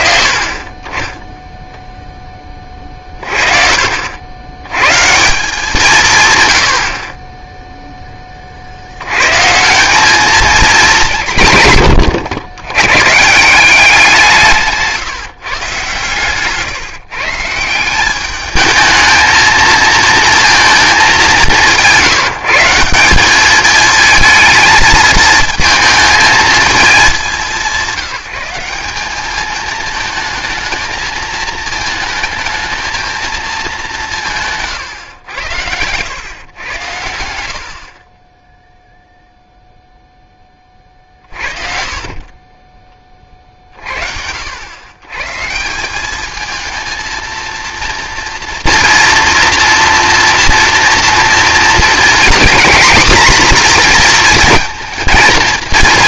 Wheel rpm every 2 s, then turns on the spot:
10, 40, 120, 50, 70, 200, 110, 160, 150, 210, 220, 170, 220, 220, 200, 220, 220, 140, 110, 0, 20, 20, 110, 220, 230, 230, 250, 230.
14-16